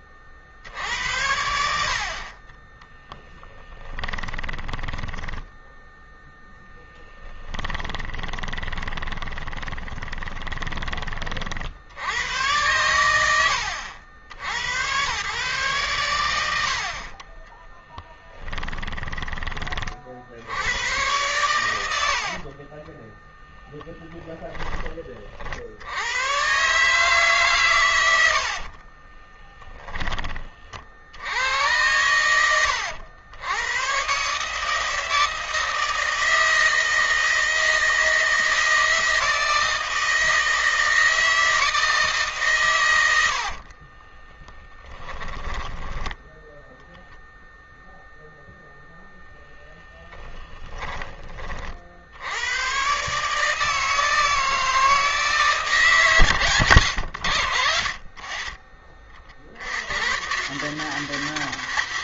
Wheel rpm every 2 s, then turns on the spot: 80, 10, 10, 10, 20, 30, 90, 120, 50, 20, 100, 10, 30, 140, 20, 80, 110, 160, 160, 160, 160, 100, 10, 0, 20, 30, 140, 160, 100, 50, 170.
2-10 16-18 22-24 28-30 42-46